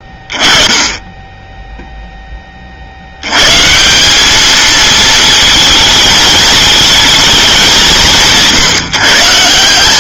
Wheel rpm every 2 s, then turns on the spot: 20, 40, 220, 220, 150.
none